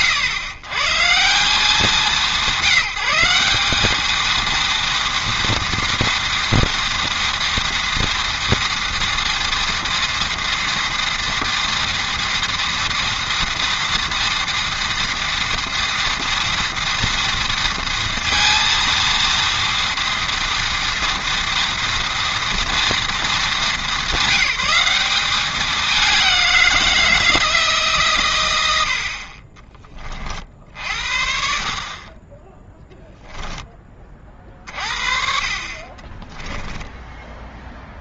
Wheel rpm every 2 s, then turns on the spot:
140, 190, 230, 230, 230, 230, 230, 230, 230, 230, 230, 230, 200, 170, 80, 60, 10, 40, 10.
36-38